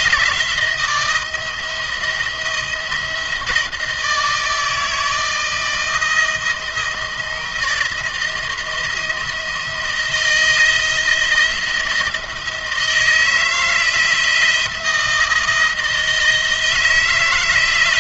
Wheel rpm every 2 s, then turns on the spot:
170, 170, 160, 160, 160, 170, 160, 170, 160.
none